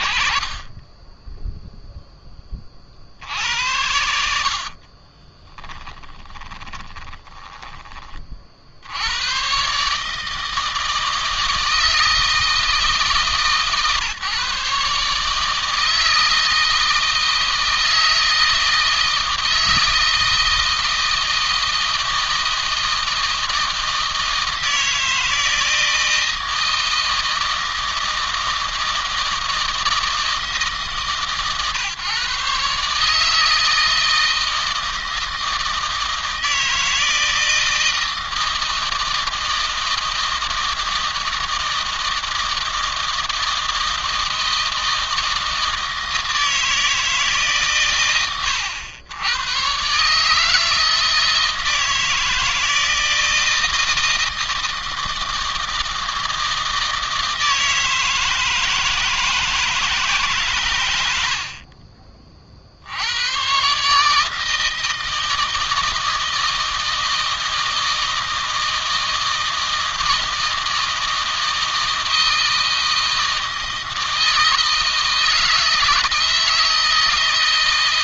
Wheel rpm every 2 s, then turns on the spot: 40, 30, 60, 20, 50, 160, 160, 150, 160, 160, 160, 160, 160, 160, 160, 150, 140, 160, 160, 160, 160, 160, 160, 160, 90, 160, 160, 160, 160, 160, 120, 50, 160, 160, 160, 160, 160, 160, 170.
4-8